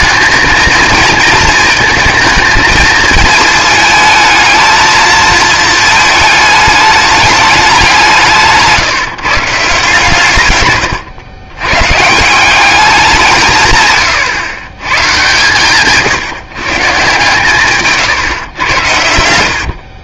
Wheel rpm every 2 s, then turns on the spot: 220, 220, 220, 220, 160, 130, 190, 110, 140, 110.
8-10